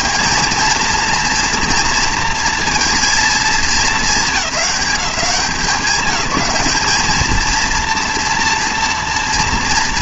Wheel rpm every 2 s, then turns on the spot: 210, 230, 210, 200, 240.
none